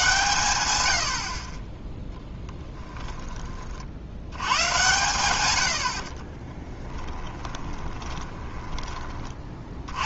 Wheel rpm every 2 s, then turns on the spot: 90, 10, 110, 20, 10.
2-4 6-8